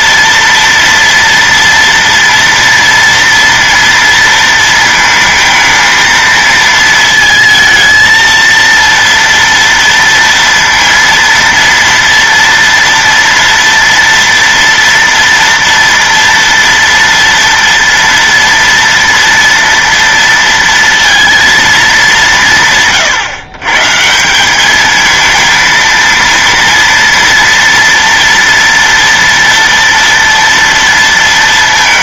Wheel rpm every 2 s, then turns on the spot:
230, 230, 230, 220, 230, 230, 230, 230, 230, 230, 230, 160, 200, 230, 230, 230.
none